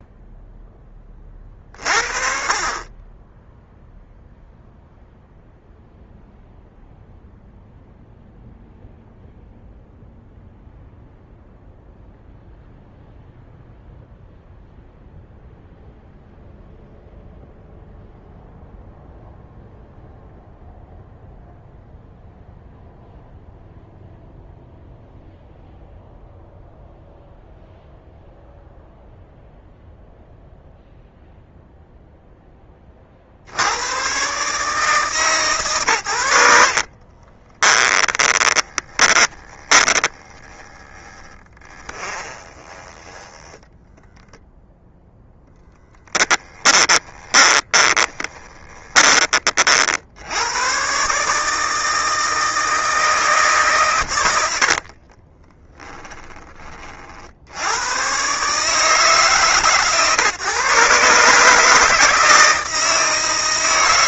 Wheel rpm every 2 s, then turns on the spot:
20, 30, 0, 0, 0, 0, 0, 0, 0, 0, 0, 0, 0, 0, 0, 0, 30, 150, 40, 20, 10, 20, 0, 20, 30, 120, 160, 50, 40, 150, 130, 160.
36-44 46-50 54-56